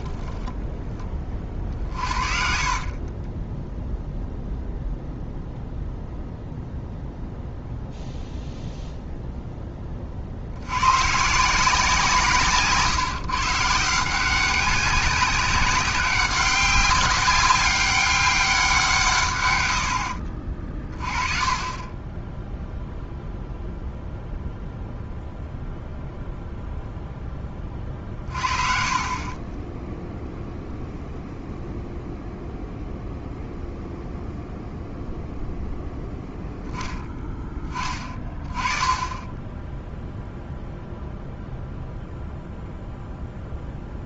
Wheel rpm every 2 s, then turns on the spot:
10, 60, 0, 0, 0, 80, 150, 190, 190, 180, 30, 0, 0, 0, 40, 0, 0, 0, 10, 30, 0, 0.
2-4 12-14 28-30